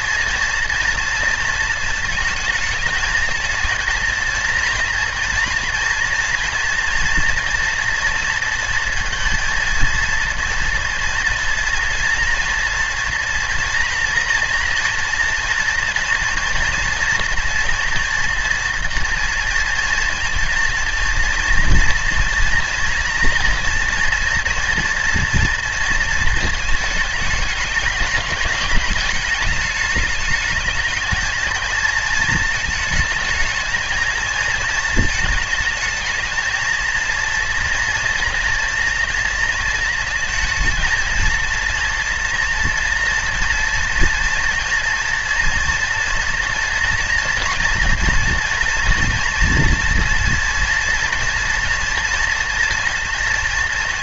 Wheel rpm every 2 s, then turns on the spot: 230, 220, 230, 240, 230, 240, 230, 230, 230, 230, 230, 230, 230, 220, 200, 210, 220, 220, 230, 230, 220, 240, 230, 230, 230, 230, 230.
none